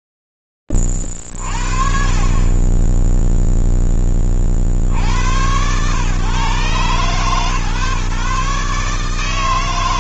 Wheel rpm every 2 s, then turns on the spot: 0, 40, 10, 90, 140.
none